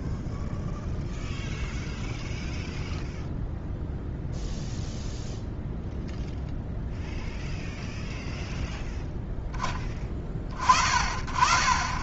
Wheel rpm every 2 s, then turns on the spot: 0, 0, 0, 0, 0, 30.
none